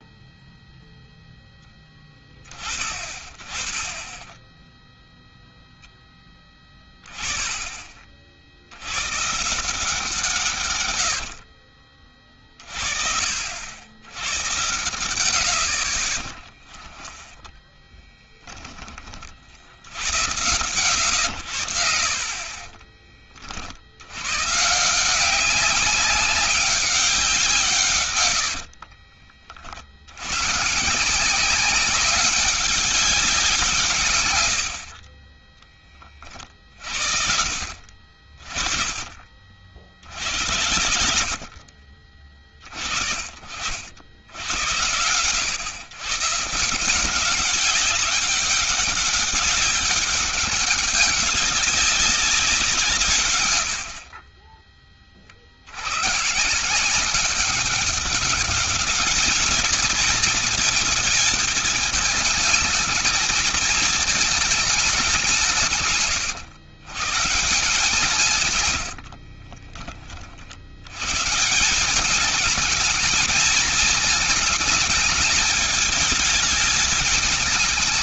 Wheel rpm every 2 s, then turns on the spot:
0, 20, 10, 10, 50, 150, 40, 100, 20, 10, 90, 40, 130, 200, 80, 110, 200, 100, 40, 40, 80, 40, 90, 150, 200, 200, 180, 30, 140, 200, 220, 210, 210, 130, 130, 70, 210, 220, 210.
16-18 22-24 28-30